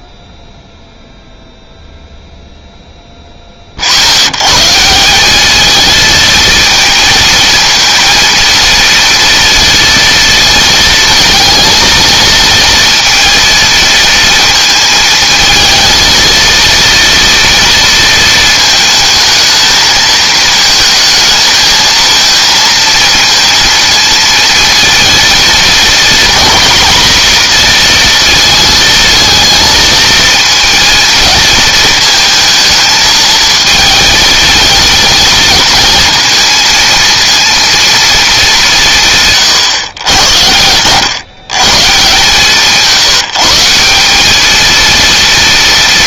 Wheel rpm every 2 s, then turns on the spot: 0, 0, 160, 220, 230, 220, 230, 220, 230, 220, 220, 230, 230, 230, 230, 230, 230, 220, 230, 170, 110, 170, 230.
none